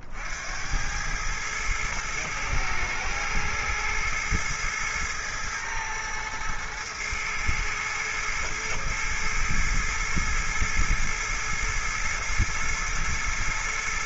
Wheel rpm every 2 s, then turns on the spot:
90, 110, 110, 110, 110, 110, 110.
none